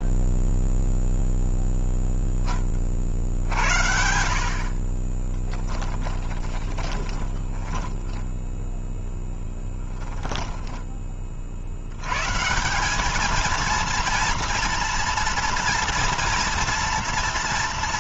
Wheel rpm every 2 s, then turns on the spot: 0, 20, 50, 20, 10, 20, 170, 230, 230.
4-10